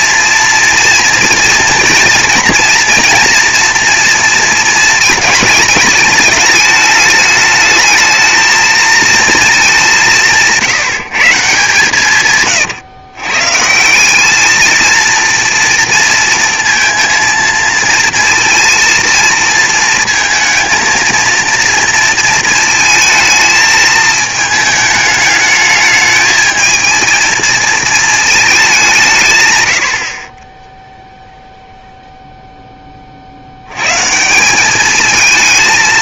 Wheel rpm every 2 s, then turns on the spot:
230, 230, 220, 220, 230, 170, 130, 220, 230, 230, 220, 220, 220, 220, 200, 10, 10, 200.
none